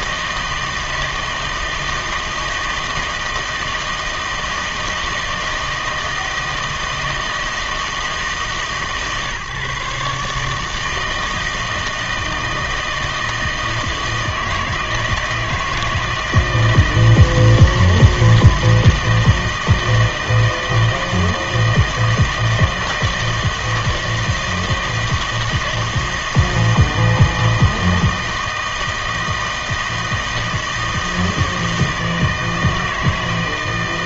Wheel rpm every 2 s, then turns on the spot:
160, 160, 160, 160, 150, 150, 160, 160, 160, 160, 160, 160, 160, 160, 160, 160, 160.
none